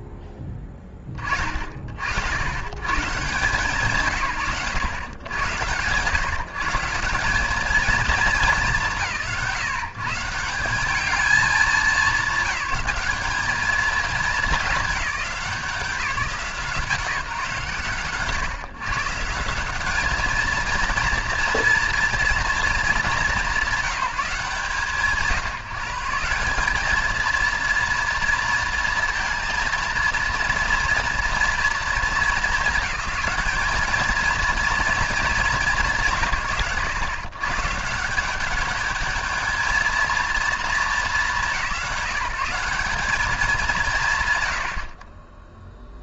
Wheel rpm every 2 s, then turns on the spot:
10, 100, 110, 180, 170, 200, 200, 190, 170, 150, 230, 210, 160, 220, 230, 230, 210, 230, 110, 220, 200, 200, 30.
none